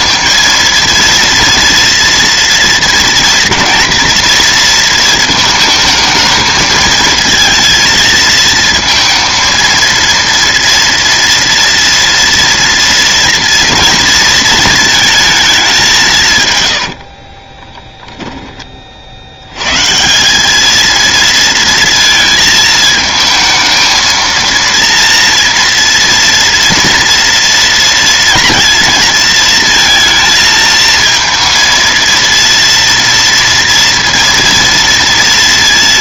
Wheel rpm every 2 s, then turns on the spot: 230, 230, 230, 220, 230, 230, 230, 220, 110, 20, 210, 220, 230, 240, 230, 230, 230, 230.
16-18